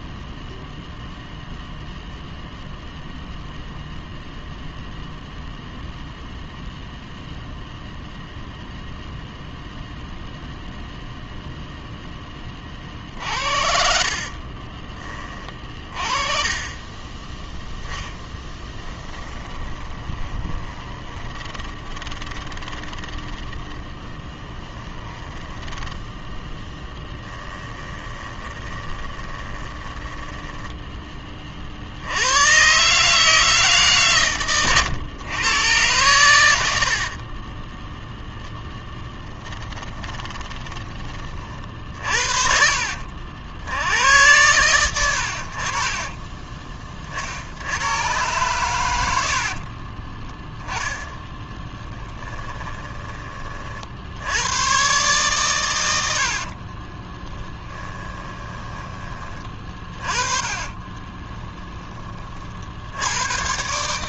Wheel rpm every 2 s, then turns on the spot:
0, 0, 0, 0, 0, 0, 40, 30, 20, 10, 20, 20, 10, 10, 20, 10, 140, 110, 60, 0, 20, 50, 100, 40, 100, 10, 20, 120, 30, 20, 20, 80.
18-26 28-30 50-54 56-58 60-62